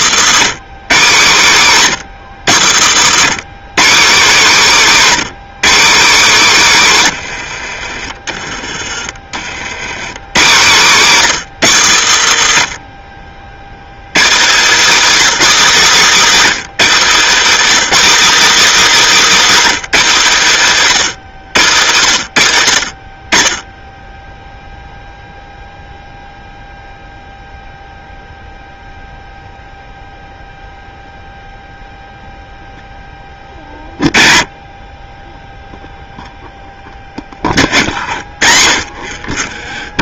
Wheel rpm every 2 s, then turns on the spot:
180, 110, 240, 150, 30, 180, 60, 270, 240, 300, 180, 30, 0, 0, 0, 0, 10, 20, 20, 30.
2-4 12-14